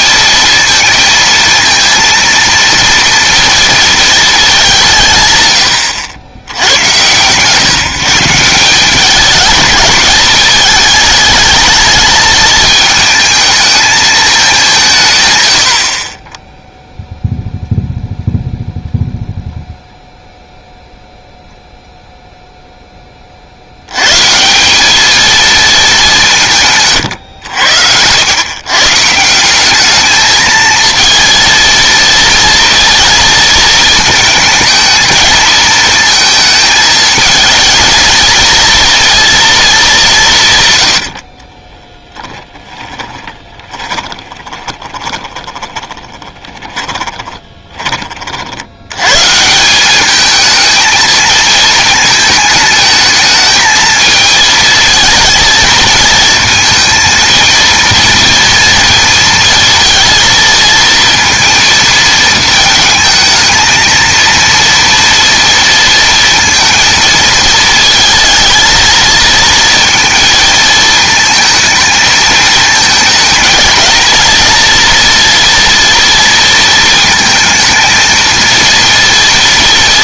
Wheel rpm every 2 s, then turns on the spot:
230, 230, 190, 110, 180, 210, 220, 180, 0, 0, 0, 0, 190, 130, 140, 220, 230, 220, 220, 230, 130, 20, 20, 20, 90, 220, 220, 230, 220, 230, 230, 230, 230, 230, 220, 230, 220, 230, 230, 230.
42-48